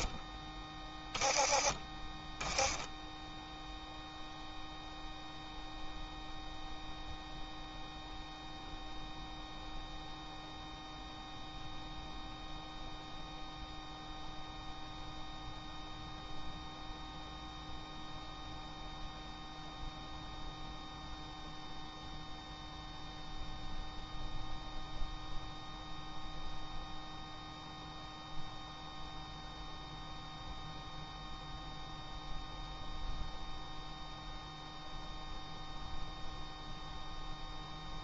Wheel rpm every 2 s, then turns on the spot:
10, 10, 0, 0, 0, 0, 0, 0, 0, 0, 0, 0, 0, 0, 0, 0, 0, 0, 0.
none